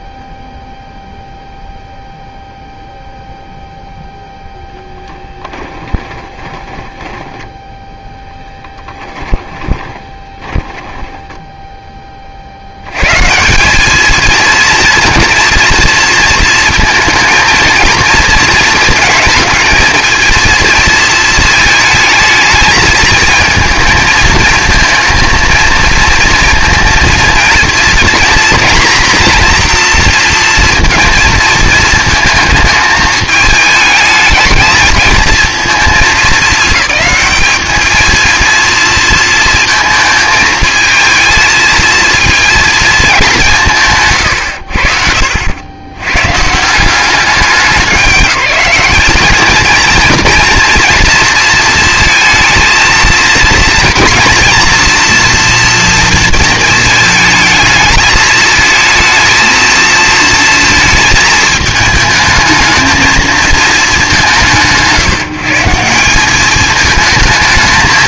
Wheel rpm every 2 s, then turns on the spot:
0, 0, 0, 20, 10, 20, 60, 230, 230, 230, 230, 220, 220, 230, 240, 230, 220, 220, 210, 230, 220, 230, 70, 160, 200, 230, 230, 240, 220, 220, 220, 220, 130, 210.
6-12